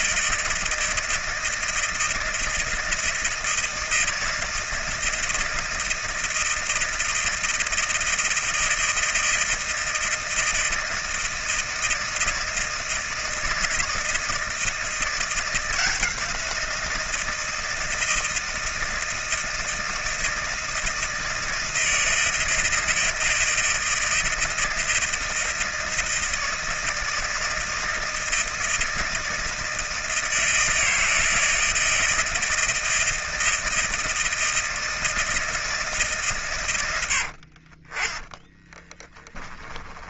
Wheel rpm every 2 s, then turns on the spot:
160, 160, 160, 160, 160, 160, 160, 160, 170, 160, 160, 160, 160, 160, 160, 160, 160, 160, 120, 10.
38-40